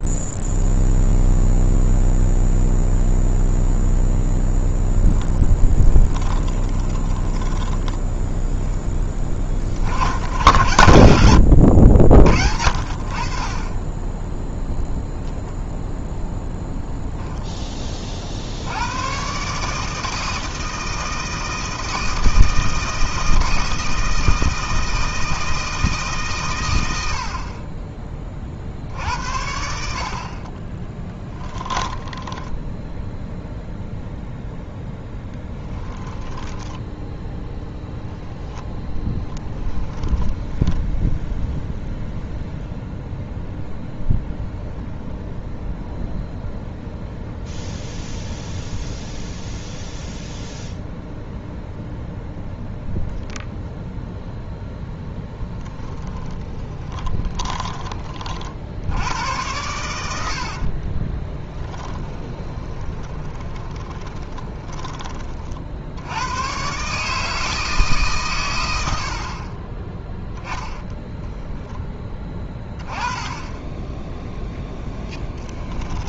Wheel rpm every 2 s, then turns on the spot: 0, 0, 0, 10, 10, 100, 60, 0, 0, 90, 160, 160, 160, 110, 70, 20, 10, 0, 10, 10, 10, 0, 0, 0, 0, 0, 0, 10, 30, 80, 30, 10, 20, 140, 90, 10, 20, 10.
6-8 10-12 30-34 36-38 54-58 60-64 70-72 74-76